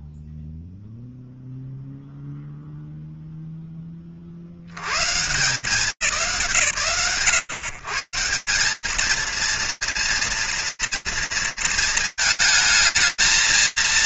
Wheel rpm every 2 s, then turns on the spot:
0, 80, 140, 210, 230, 220, 230.
none